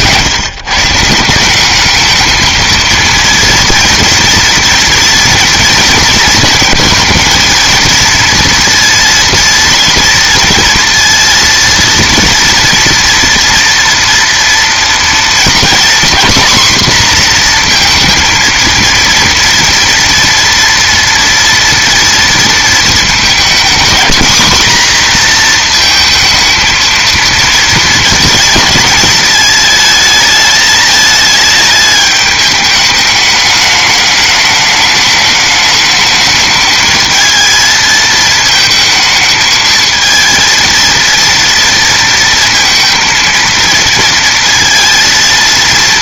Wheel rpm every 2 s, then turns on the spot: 130, 220, 230, 230, 230, 230, 230, 230, 240, 230, 230, 230, 240, 230, 240, 220, 210, 210, 210, 220, 230, 230, 230.
none